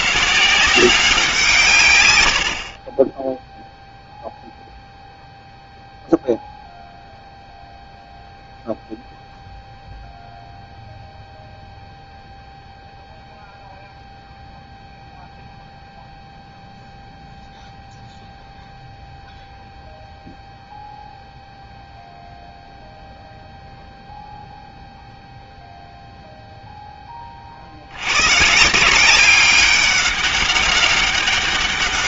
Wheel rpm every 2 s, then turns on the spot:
180, 60, 0, 0, 0, 0, 0, 0, 0, 0, 0, 0, 0, 0, 150, 200.
2-4